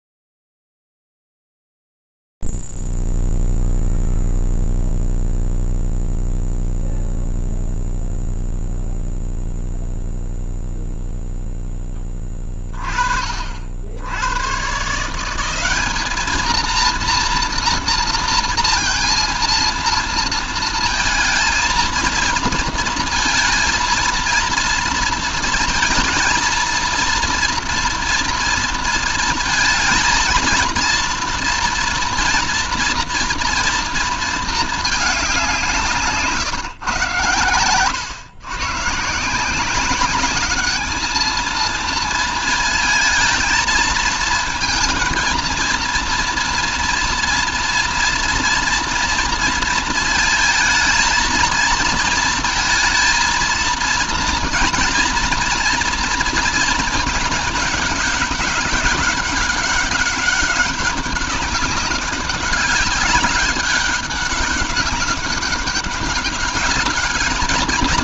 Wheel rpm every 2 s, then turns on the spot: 0, 0, 0, 0, 0, 0, 10, 80, 200, 230, 230, 230, 230, 230, 230, 230, 230, 230, 150, 120, 200, 230, 230, 230, 230, 220, 230, 230, 230, 200, 200, 190, 200, 200.
none